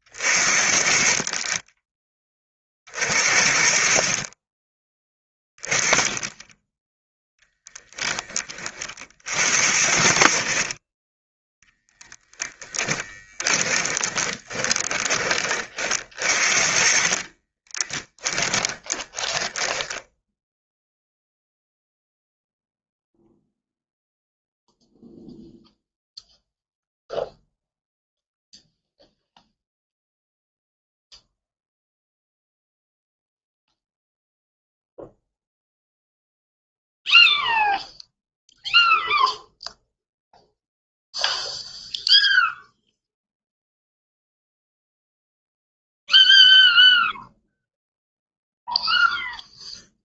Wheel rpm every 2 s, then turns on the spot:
40, 40, 20, 10, 30, 30, 10, 20, 50, 20, 0, 0, 0, 0, 0, 0, 0, 0, 0, 0, 0, 0, 0, 0, 0.
12-20